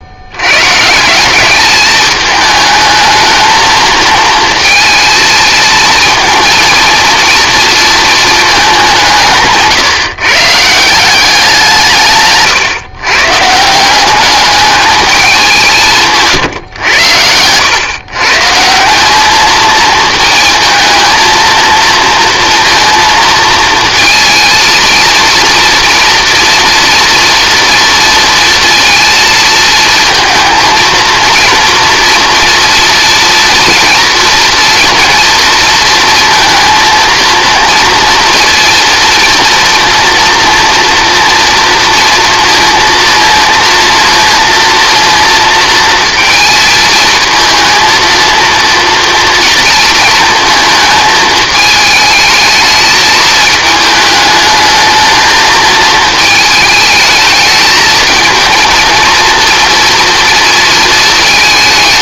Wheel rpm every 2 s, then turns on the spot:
140, 220, 230, 230, 190, 160, 130, 210, 110, 180, 220, 230, 230, 230, 220, 230, 230, 230, 230, 230, 230, 230, 230, 220, 230, 220, 220, 220, 220, 230, 230.
none